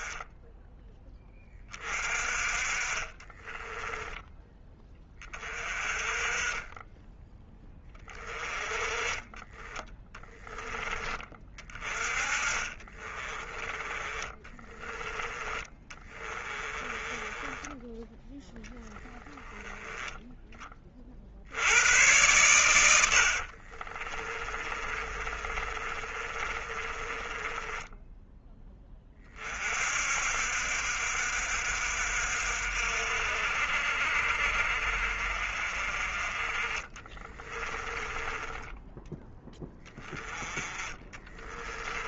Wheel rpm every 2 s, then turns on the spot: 10, 40, 20, 20, 20, 30, 30, 30, 20, 10, 30, 90, 30, 30, 20, 60, 60, 50, 30, 10, 20.
2-4 12-14 16-20 22-28 36-38 40-42